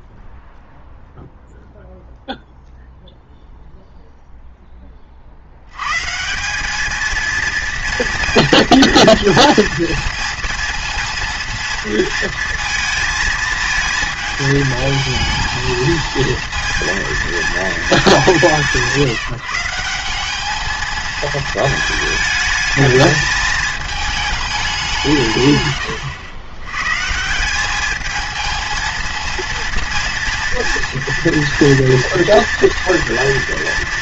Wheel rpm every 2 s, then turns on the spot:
0, 0, 10, 200, 230, 230, 230, 220, 230, 180, 210, 220, 200, 120, 230, 230, 240.
none